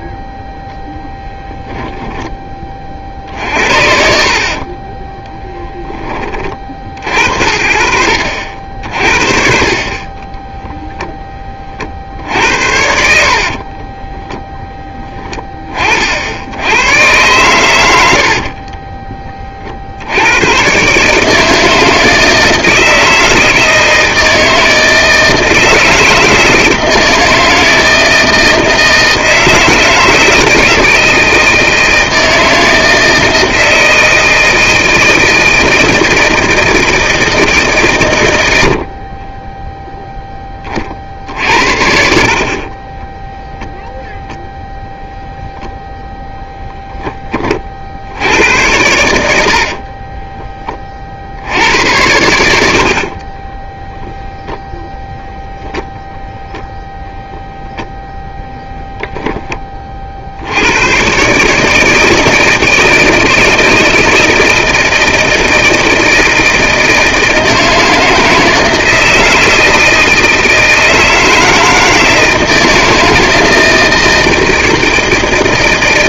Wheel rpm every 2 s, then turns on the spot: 0, 40, 30, 50, 50, 0, 60, 20, 90, 30, 120, 160, 160, 160, 160, 160, 160, 160, 160, 80, 30, 30, 0, 10, 90, 20, 70, 0, 0, 10, 90, 160, 160, 160, 160, 160, 160, 160.
4-6 12-14 18-20 42-44 52-54